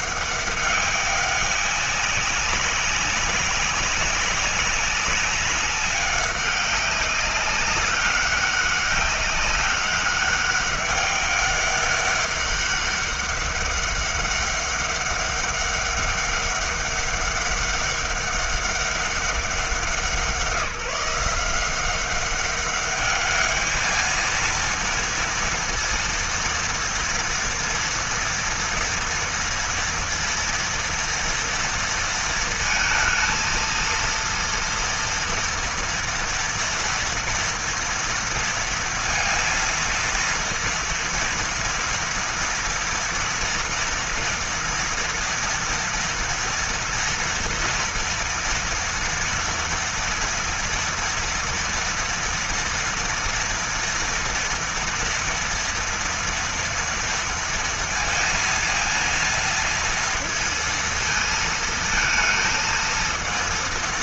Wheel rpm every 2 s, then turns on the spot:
190, 200, 200, 200, 200, 200, 200, 200, 200, 190, 170, 200, 230, 230, 230, 230, 220, 230, 230, 230, 230, 230, 230, 230, 230, 230, 230, 230, 240, 230, 230, 230.
none